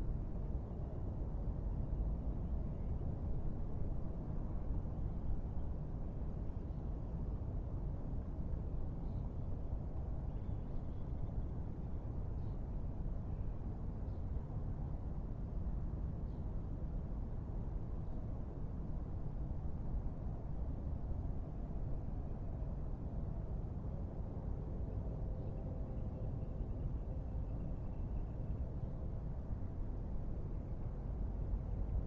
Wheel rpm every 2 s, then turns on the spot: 0, 0, 0, 0, 0, 0, 0, 0, 0, 0, 0, 0, 0, 0, 0, 0.
none